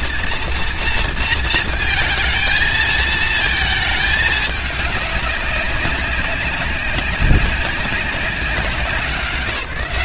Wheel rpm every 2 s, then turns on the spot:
230, 220, 210, 190, 190.
none